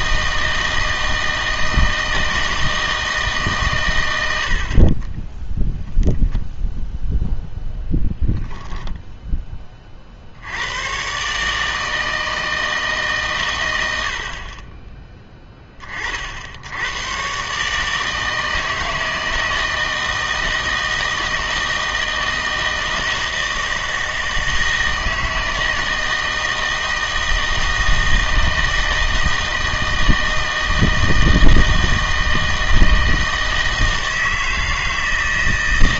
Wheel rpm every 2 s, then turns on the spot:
160, 160, 60, 0, 10, 90, 160, 30, 80, 160, 160, 160, 160, 160, 160, 160, 160, 160.
none